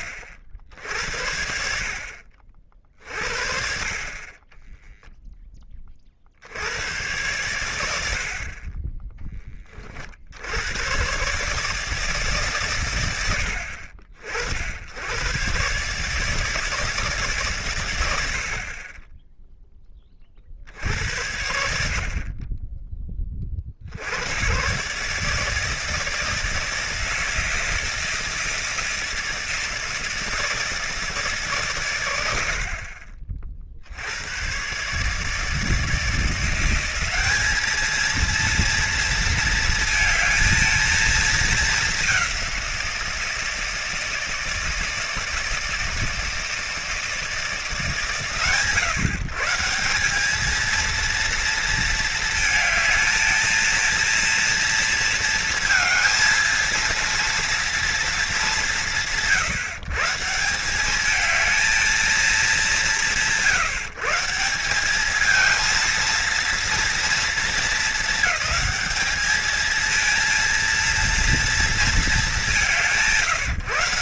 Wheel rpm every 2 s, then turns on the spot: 60, 50, 20, 90, 40, 90, 140, 60, 150, 60, 50, 30, 110, 160, 160, 160, 70, 120, 170, 230, 220, 190, 160, 160, 130, 220, 220, 230, 230, 170, 160, 190, 180, 230, 220, 230, 190.
none